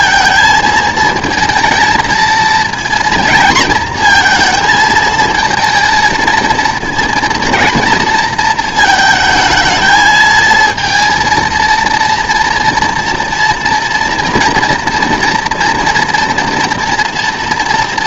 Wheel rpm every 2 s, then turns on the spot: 230, 230, 220, 220, 220, 230, 240, 230, 230.
none